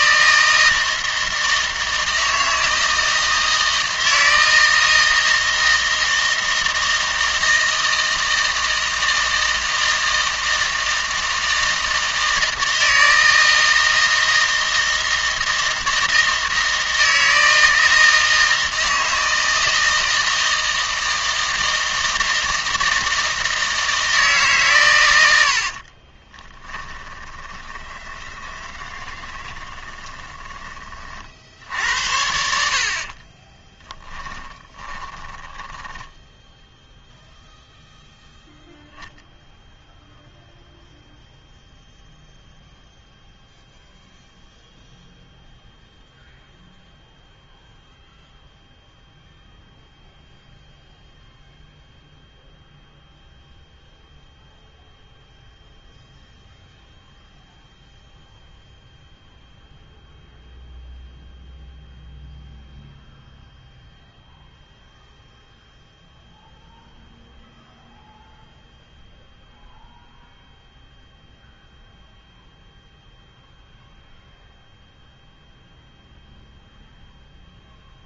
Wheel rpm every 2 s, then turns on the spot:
160, 160, 160, 160, 160, 160, 160, 160, 160, 160, 160, 160, 120, 10, 30, 20, 60, 20, 0, 0, 0, 0, 0, 0, 0, 0, 0, 0, 0, 0, 0, 0, 0, 0, 0, 0, 0, 0, 0.
26-30 34-36